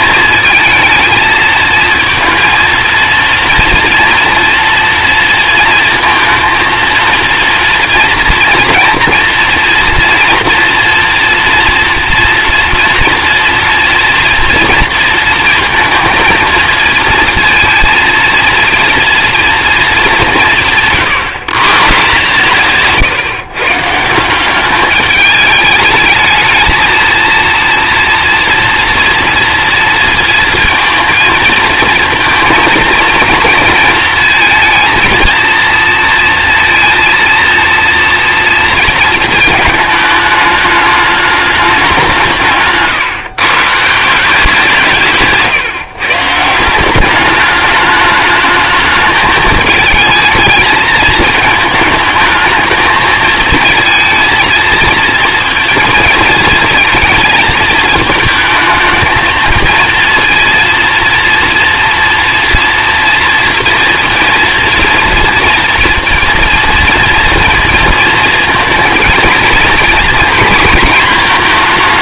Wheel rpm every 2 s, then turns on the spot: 230, 230, 230, 230, 230, 230, 230, 230, 230, 230, 140, 140, 210, 230, 230, 230, 230, 230, 230, 220, 210, 140, 150, 210, 220, 220, 220, 230, 220, 220, 230, 230, 230, 230, 230, 230.
none